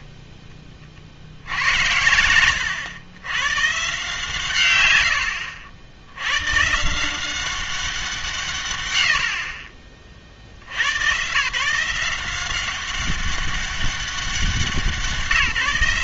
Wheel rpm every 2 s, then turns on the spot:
20, 110, 130, 130, 130, 90, 190, 180.
2-4